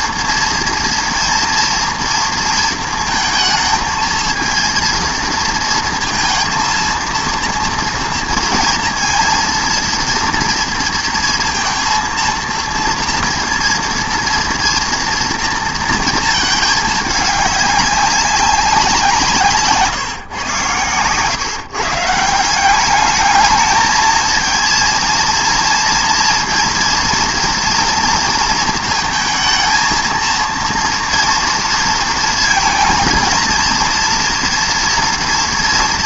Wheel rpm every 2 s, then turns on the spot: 230, 230, 230, 230, 230, 230, 230, 230, 220, 190, 120, 180, 230, 230, 230, 230, 230, 240.
none